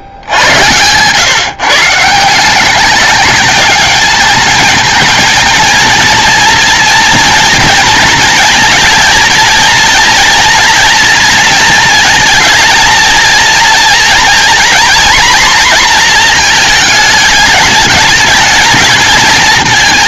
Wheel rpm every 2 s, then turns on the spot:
130, 160, 210, 230, 230, 230, 230, 230, 230, 210.
none